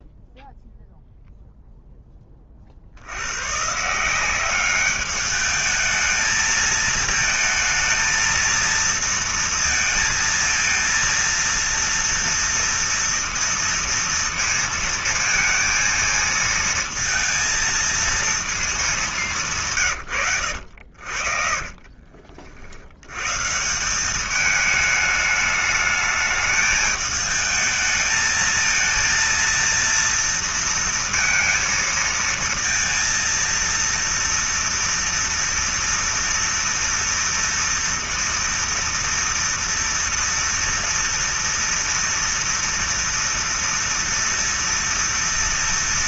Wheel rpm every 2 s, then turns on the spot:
0, 10, 180, 220, 220, 230, 230, 230, 230, 230, 120, 40, 190, 210, 220, 230, 230, 230, 230, 230, 230, 230, 230.
20-24